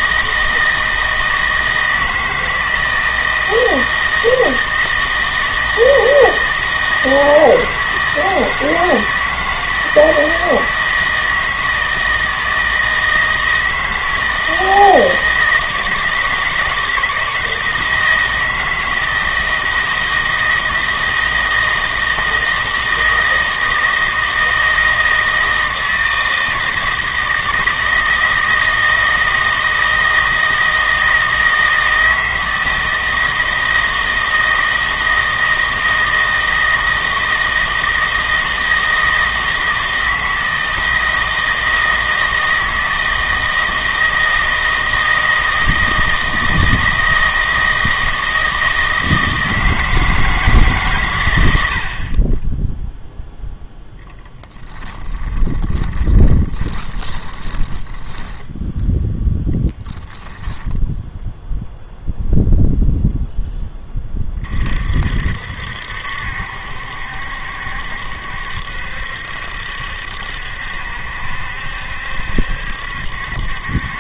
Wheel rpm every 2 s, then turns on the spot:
160, 160, 160, 160, 160, 160, 160, 160, 160, 160, 160, 160, 160, 160, 160, 160, 160, 160, 160, 160, 160, 160, 160, 160, 160, 140, 0, 10, 20, 10, 20, 0, 40, 70, 70, 70, 70.
54-58 60-62